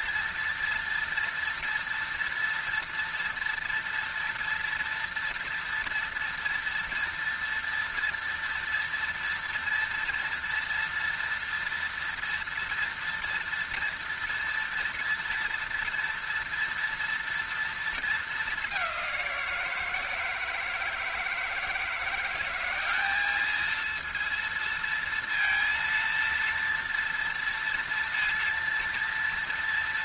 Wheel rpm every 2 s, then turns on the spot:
230, 230, 230, 230, 230, 230, 230, 230, 230, 200, 170, 190, 230, 230, 230.
none